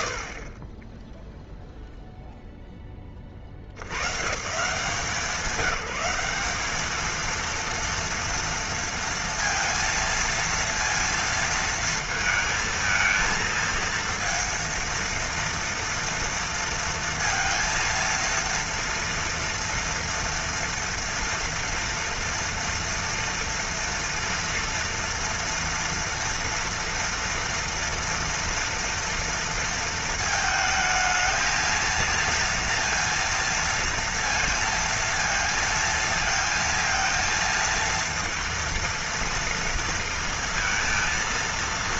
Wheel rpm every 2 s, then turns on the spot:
20, 180, 220, 230, 230, 230, 230, 230, 230, 230, 230, 230, 230, 230, 220, 230, 230, 230, 230, 230, 230.
none